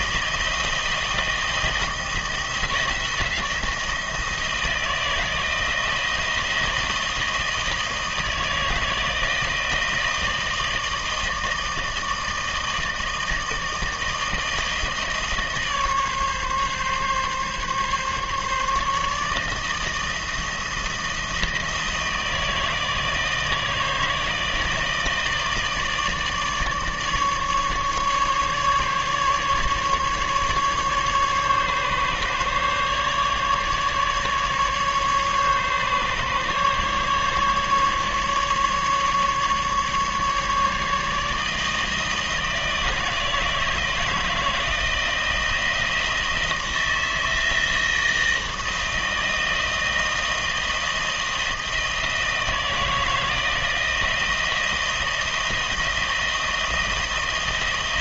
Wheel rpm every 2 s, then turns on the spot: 160, 170, 160, 170, 160, 160, 160, 160, 140, 150, 160, 160, 160, 150, 150, 140, 140, 140, 150, 150, 150, 160, 170, 160, 160, 160, 160, 160, 170.
none